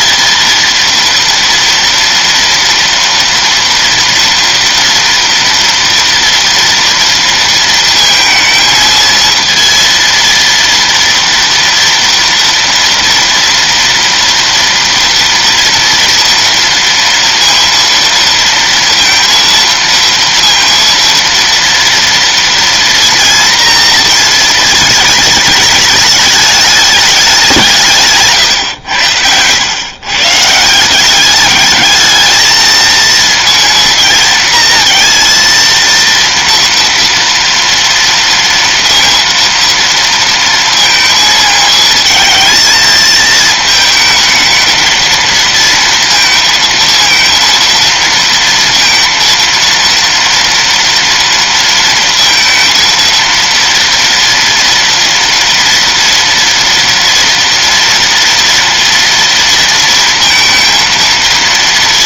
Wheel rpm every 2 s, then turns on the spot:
230, 240, 230, 230, 220, 230, 230, 230, 230, 230, 230, 230, 220, 210, 130, 160, 220, 230, 230, 230, 230, 220, 220, 230, 230, 230, 230, 240, 230, 230, 230.
none